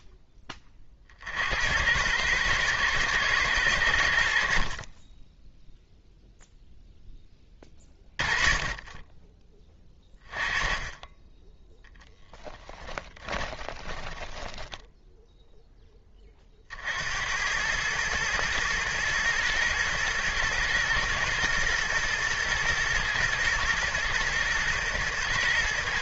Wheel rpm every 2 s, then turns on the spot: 20, 110, 50, 0, 20, 20, 10, 0, 50, 110, 120, 120, 120.
12-14